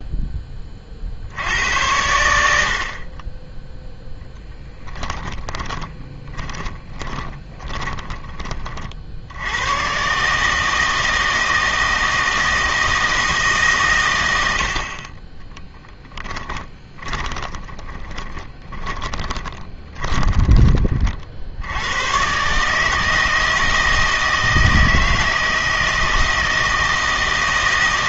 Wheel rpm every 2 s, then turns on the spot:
40, 60, 10, 20, 40, 160, 160, 70, 10, 20, 30, 150, 160, 160.
4-8 16-20